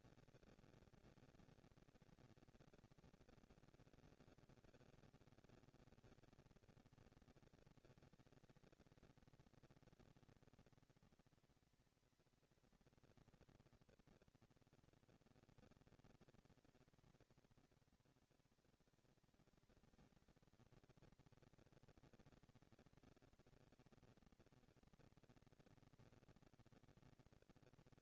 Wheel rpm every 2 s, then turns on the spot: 230, 230, 230, 220, 220, 230, 230, 210, 210, 220, 220, 230, 220, 240.
none